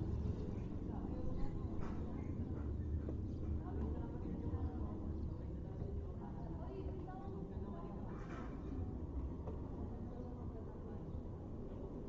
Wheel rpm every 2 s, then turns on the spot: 0, 0, 0, 0, 0, 0.
none